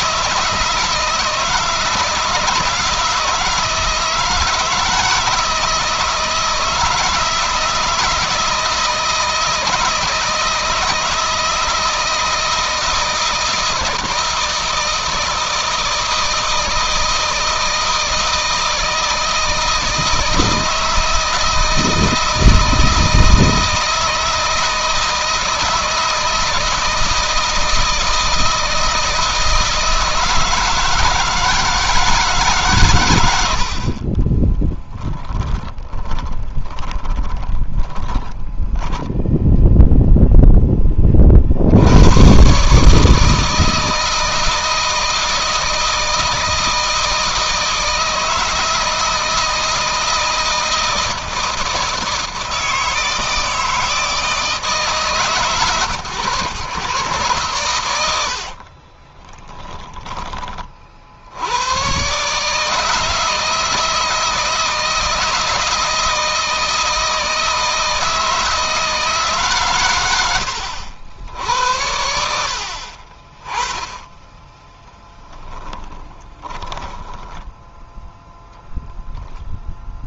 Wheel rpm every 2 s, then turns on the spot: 160, 170, 160, 160, 160, 160, 160, 160, 160, 160, 160, 160, 160, 160, 160, 160, 130, 20, 20, 10, 20, 150, 160, 160, 160, 160, 160, 150, 120, 40, 50, 160, 160, 160, 160, 80, 50, 10, 10, 0.
34-40 58-60 74-78